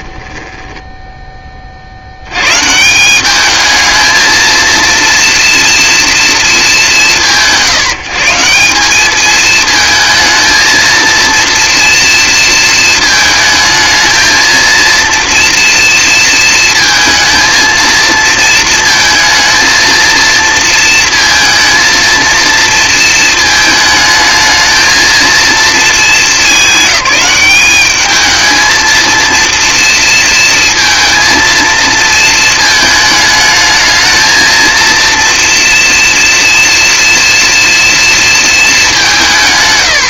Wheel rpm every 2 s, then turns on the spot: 10, 140, 230, 200, 180, 230, 220, 230, 230, 230, 230, 230, 220, 200, 230, 230, 220, 230, 230, 220.
0-2